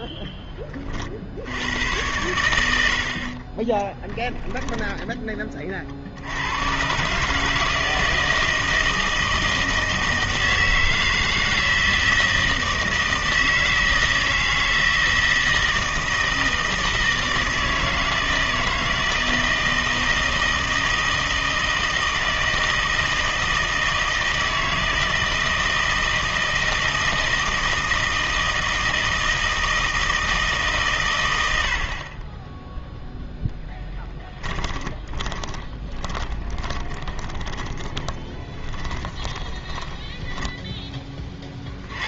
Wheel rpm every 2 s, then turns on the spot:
10, 90, 10, 100, 160, 160, 160, 160, 160, 160, 160, 160, 160, 160, 160, 150, 10, 20, 20, 30, 10.
34-40